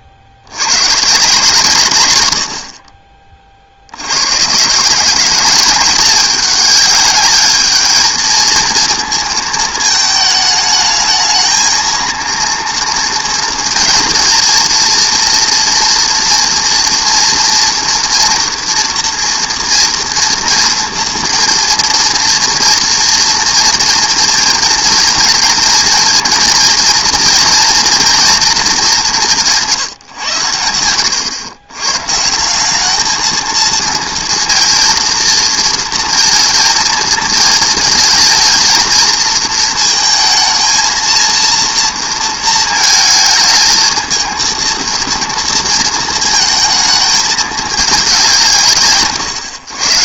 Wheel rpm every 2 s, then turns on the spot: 70, 50, 160, 210, 230, 220, 230, 230, 240, 230, 230, 230, 230, 230, 220, 100, 190, 230, 230, 220, 220, 220, 230, 230, 100.
none